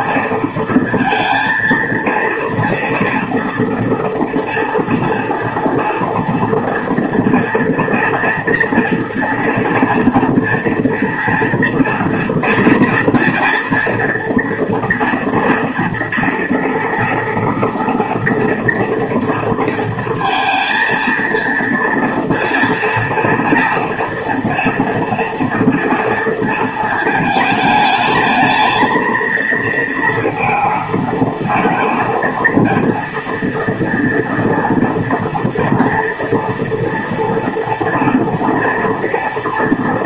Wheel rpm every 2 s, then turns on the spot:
230, 230, 230, 230, 240, 240, 230, 230, 240, 230, 230, 240, 240, 230, 220, 220, 230, 230, 230, 240.
none